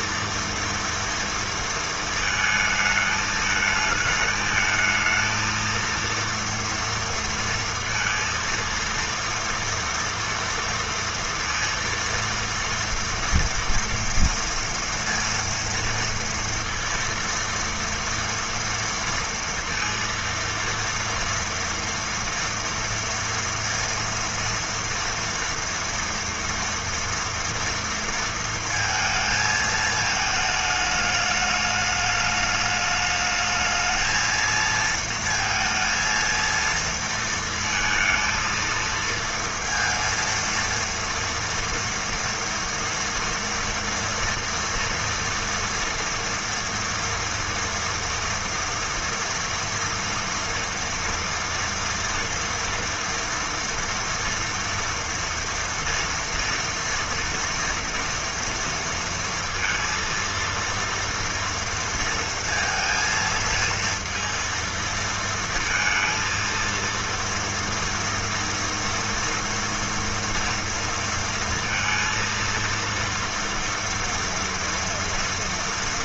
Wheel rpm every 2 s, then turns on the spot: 230, 220, 220, 230, 230, 230, 230, 230, 230, 230, 230, 230, 230, 230, 230, 220, 210, 220, 230, 230, 230, 230, 230, 230, 230, 230, 230, 230, 230, 230, 230, 230, 230, 230, 240, 230, 230, 230.
none